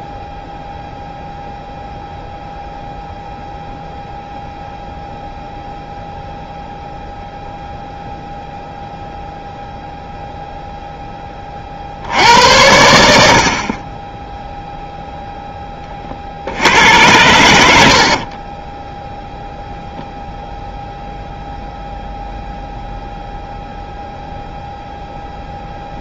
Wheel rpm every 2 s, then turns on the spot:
0, 0, 0, 0, 0, 0, 80, 0, 80, 20, 0, 0, 0.
18-20